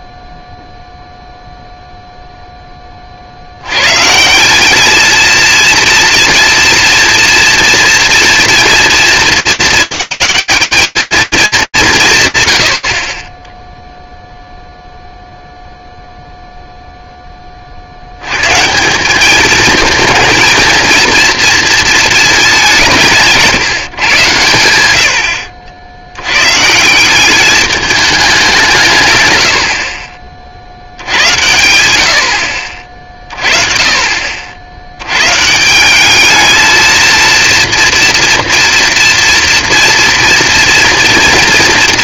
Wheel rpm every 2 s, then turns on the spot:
0, 10, 200, 230, 230, 210, 110, 0, 0, 180, 230, 170, 80, 190, 130, 90, 30, 140, 230, 230, 230.
none